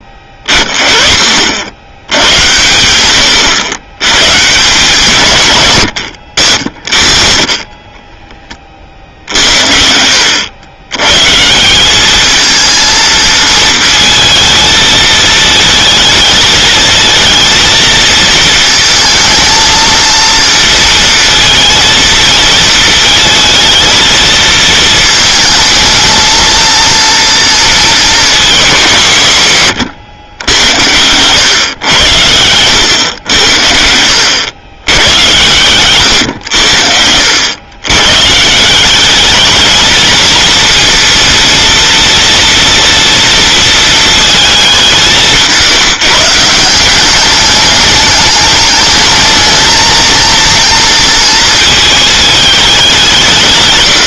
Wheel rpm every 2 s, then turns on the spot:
30, 100, 160, 60, 20, 90, 220, 220, 220, 230, 230, 220, 220, 230, 190, 90, 100, 110, 90, 160, 230, 230, 220, 170, 210, 230, 210.
none